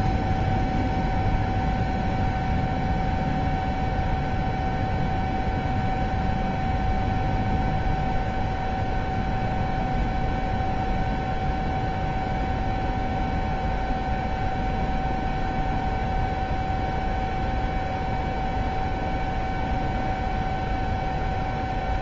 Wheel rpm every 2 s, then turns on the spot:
0, 0, 0, 0, 0, 0, 0, 0, 0, 0, 0.
none